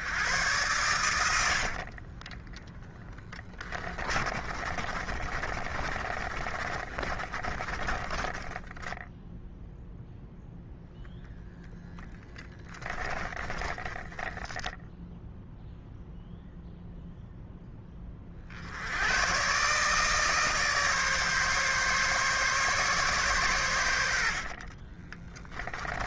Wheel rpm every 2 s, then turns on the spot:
100, 10, 30, 30, 10, 0, 10, 0, 0, 70, 150, 140, 30.
2-10 12-14 24-26